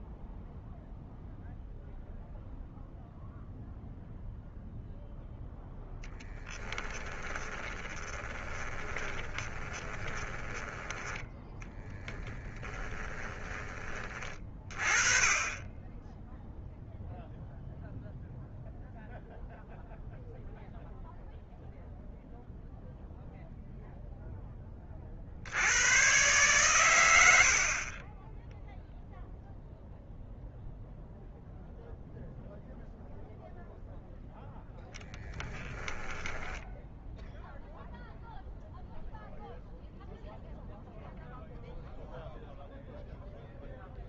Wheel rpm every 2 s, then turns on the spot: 0, 0, 0, 10, 20, 10, 10, 30, 0, 0, 0, 0, 20, 120, 20, 0, 0, 0, 10, 0, 0, 0.
6-10 12-14 36-38